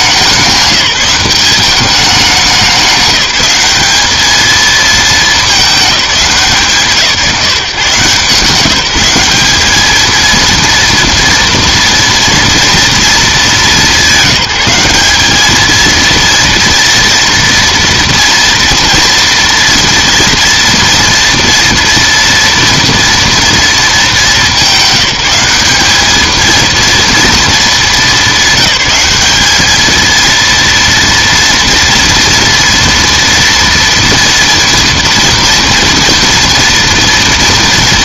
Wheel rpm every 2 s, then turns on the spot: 190, 200, 220, 160, 170, 230, 230, 190, 230, 230, 230, 230, 200, 230, 210, 230, 230, 230, 230.
none